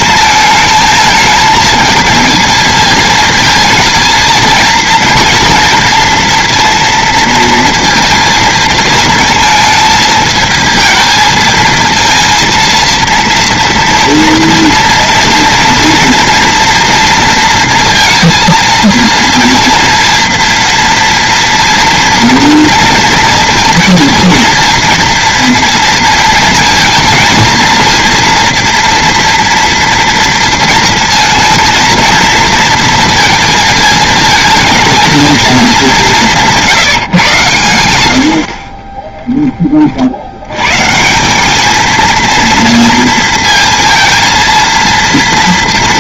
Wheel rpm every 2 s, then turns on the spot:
220, 220, 230, 230, 230, 220, 230, 230, 230, 230, 230, 230, 230, 230, 230, 230, 230, 220, 180, 50, 110, 230, 230.
none